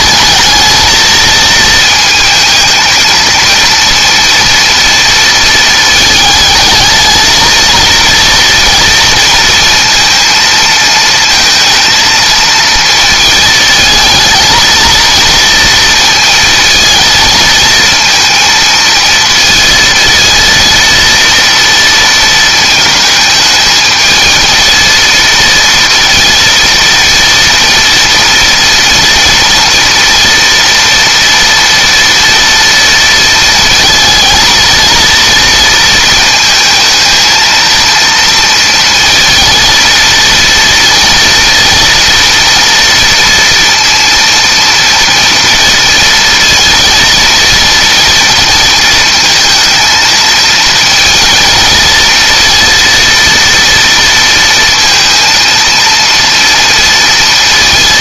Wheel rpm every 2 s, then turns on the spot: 220, 220, 230, 220, 230, 220, 230, 230, 220, 220, 230, 220, 230, 230, 230, 230, 230, 230, 220, 230, 230, 230, 230, 230, 230, 230, 230, 230, 230.
none